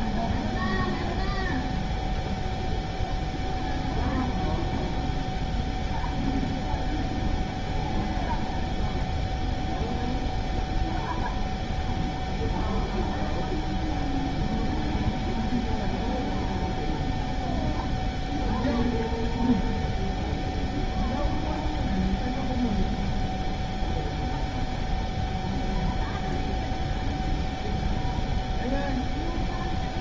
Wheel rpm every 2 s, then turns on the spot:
0, 0, 0, 0, 0, 0, 0, 0, 0, 0, 0, 0, 0, 0, 0.
none